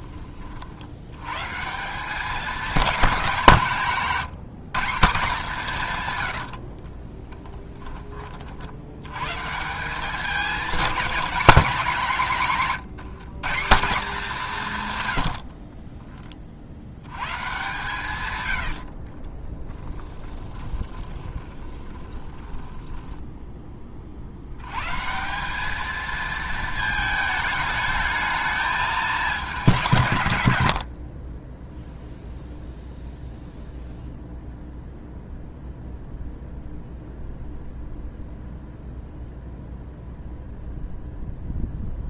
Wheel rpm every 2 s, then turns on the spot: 70, 210, 170, 40, 90, 210, 170, 140, 90, 60, 20, 10, 120, 220, 210, 70, 0, 0, 0, 0, 0.
6-8 18-24